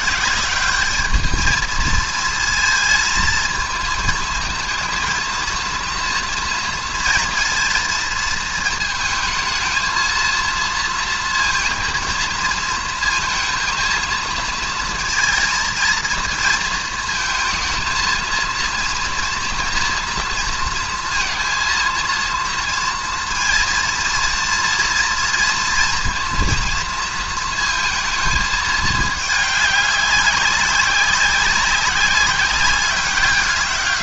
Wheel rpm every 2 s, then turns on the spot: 190, 230, 230, 230, 220, 230, 230, 230, 230, 230, 230, 230, 230, 230, 210, 190, 200.
none